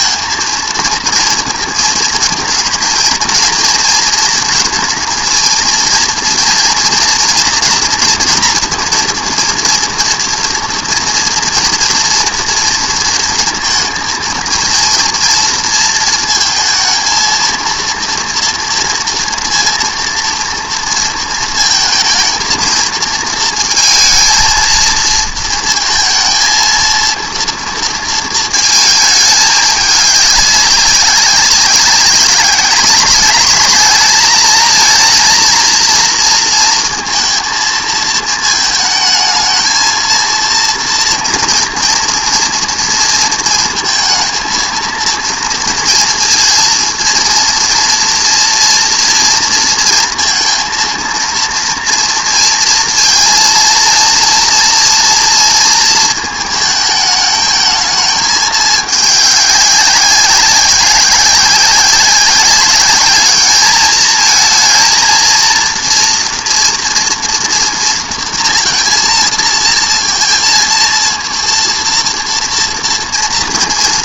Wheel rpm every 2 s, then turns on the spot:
230, 230, 230, 230, 230, 230, 230, 220, 230, 230, 230, 220, 230, 230, 220, 200, 190, 220, 230, 220, 230, 230, 230, 230, 230, 230, 230, 240, 220, 210, 190, 200, 220, 230, 230, 230, 230.
none